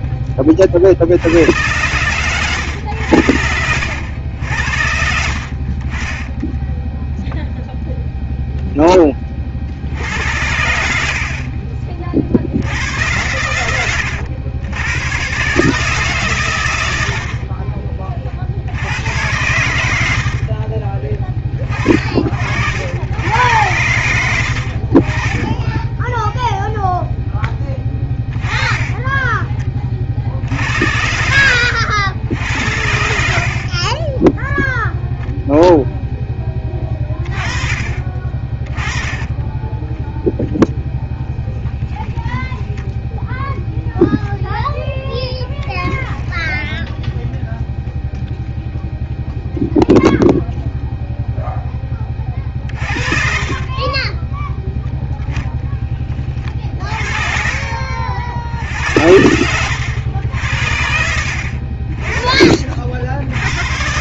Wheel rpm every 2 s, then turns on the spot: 100, 80, 60, 0, 20, 70, 100, 110, 60, 100, 30, 80, 30, 0, 20, 80, 80, 0, 20, 20, 0, 10, 0, 0, 0, 0, 50, 0, 40, 80, 80, 50.
28-30 52-54 56-58